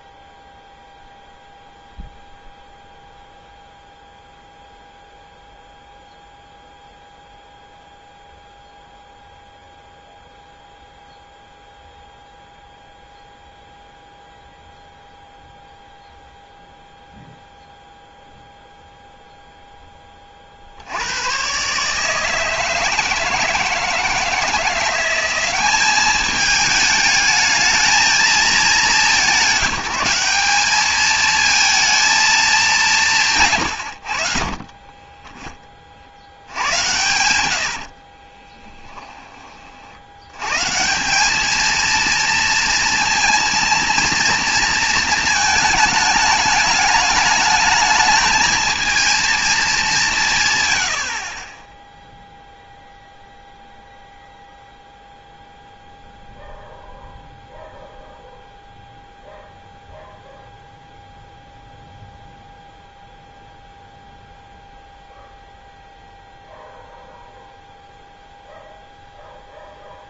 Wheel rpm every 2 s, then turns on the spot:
0, 0, 0, 0, 0, 0, 0, 0, 0, 0, 40, 160, 160, 210, 220, 200, 210, 30, 90, 20, 120, 230, 230, 210, 220, 120, 0, 0, 0, 0, 0, 0, 0, 0, 0.
36-40